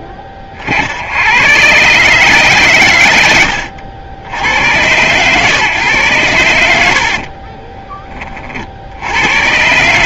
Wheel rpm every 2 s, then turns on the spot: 50, 130, 90, 100, 50.
6-8